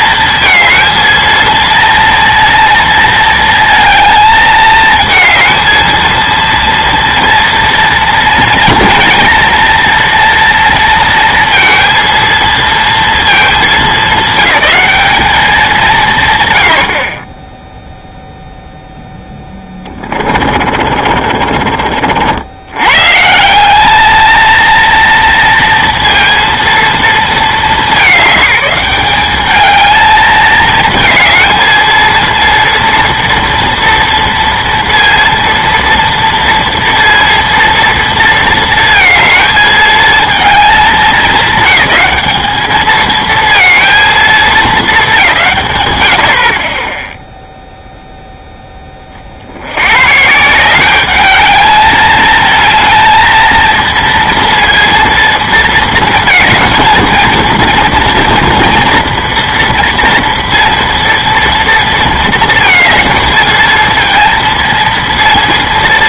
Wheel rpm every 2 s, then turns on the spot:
230, 230, 220, 230, 240, 230, 230, 210, 100, 0, 40, 90, 230, 230, 190, 220, 230, 230, 230, 230, 210, 210, 220, 30, 10, 180, 220, 230, 230, 230, 230, 230, 230.
20-22